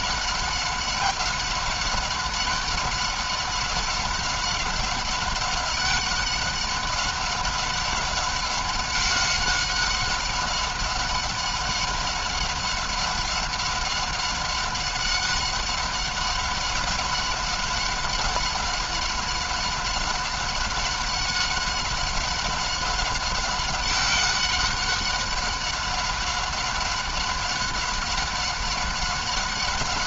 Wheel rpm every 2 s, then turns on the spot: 190, 190, 200, 190, 190, 190, 190, 190, 190, 190, 190, 190, 190, 190, 190.
none